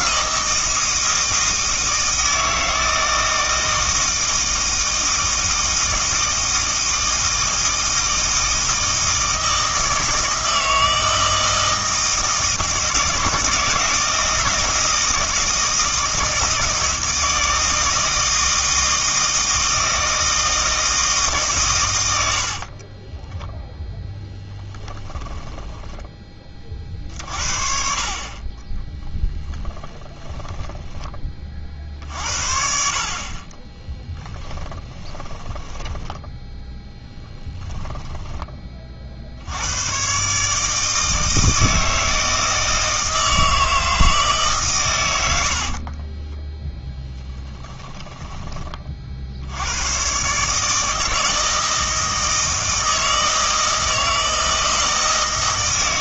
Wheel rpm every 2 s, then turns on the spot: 160, 160, 160, 160, 160, 160, 160, 160, 160, 160, 160, 40, 10, 30, 30, 10, 60, 20, 10, 20, 150, 160, 140, 10, 30, 150, 160, 160.
22-26 28-32 34-38 46-48